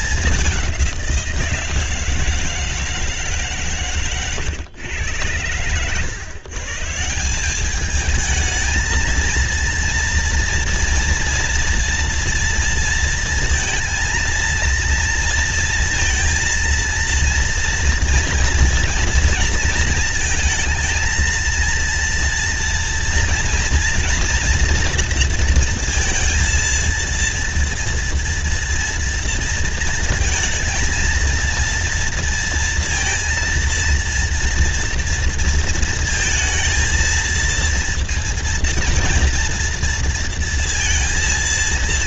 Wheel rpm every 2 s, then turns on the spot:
200, 160, 120, 140, 220, 230, 230, 230, 230, 230, 220, 230, 230, 230, 230, 230, 230, 230, 230, 230, 230.
none